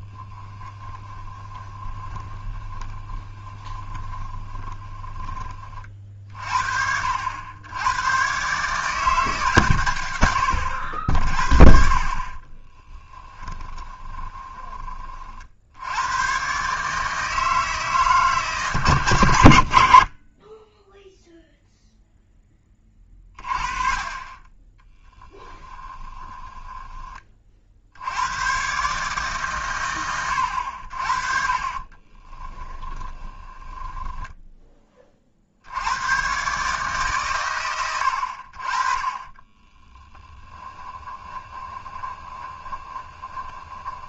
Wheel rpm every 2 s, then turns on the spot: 10, 20, 30, 50, 150, 90, 20, 20, 140, 120, 10, 20, 10, 20, 130, 80, 10, 20, 140, 40, 10, 20.
0-6 12-14 26-28 32-34 40-44